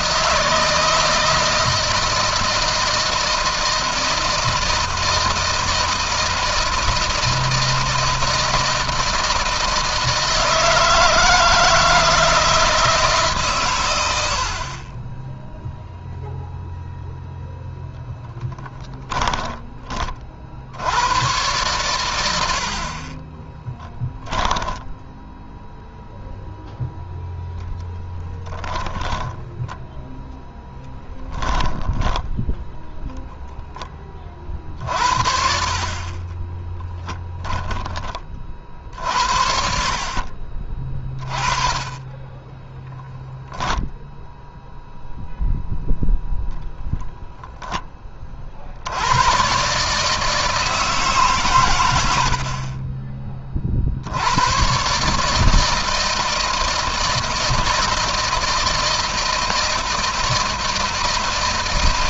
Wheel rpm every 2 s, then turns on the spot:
160, 160, 160, 160, 160, 160, 160, 50, 0, 10, 60, 80, 10, 0, 20, 10, 10, 50, 20, 50, 40, 10, 0, 10, 60, 160, 50, 110, 160, 160, 160.
18-20 24-26 28-32 36-38 42-44 52-54